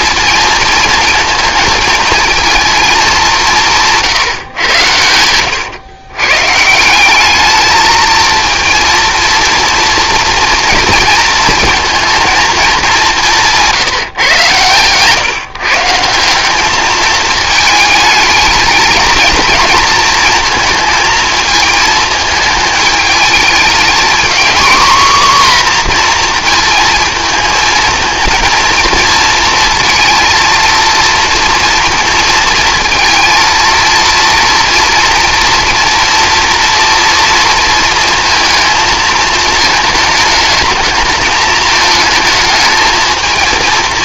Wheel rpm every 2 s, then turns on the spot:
230, 220, 110, 160, 230, 230, 210, 120, 210, 220, 230, 220, 240, 230, 230, 230, 230, 230, 230, 230, 220, 220.
none